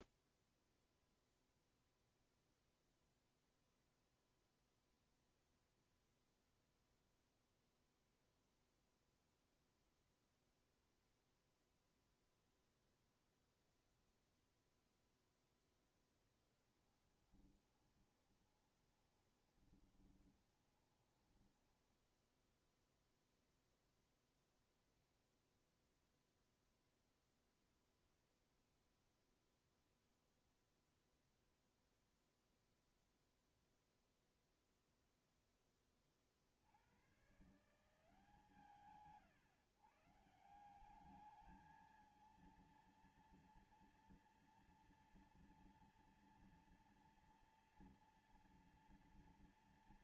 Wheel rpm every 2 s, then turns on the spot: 0, 0, 0, 0, 0, 0, 0, 0, 0, 20, 20, 10, 0, 0, 0, 0, 0, 0, 20, 130, 140, 220, 230, 230, 240.
18-24